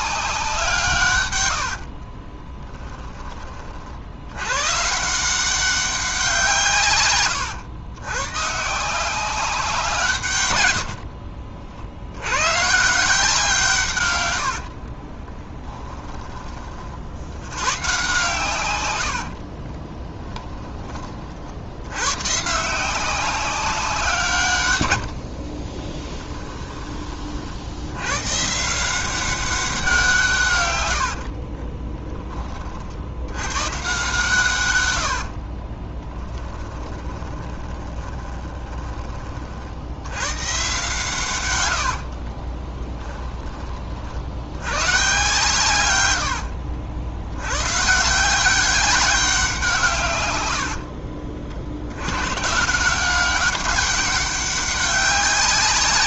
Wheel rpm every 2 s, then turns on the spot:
150, 10, 130, 140, 160, 80, 150, 50, 40, 120, 10, 160, 100, 20, 170, 110, 50, 100, 20, 20, 130, 10, 110, 70, 190, 60, 160, 190.
10-12 14-16 18-20 36-38 42-44 50-52